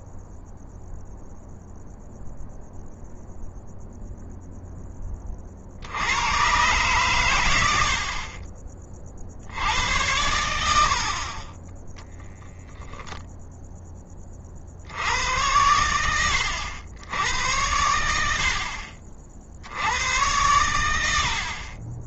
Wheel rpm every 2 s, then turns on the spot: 0, 0, 20, 110, 50, 50, 0, 80, 90, 40, 80.
none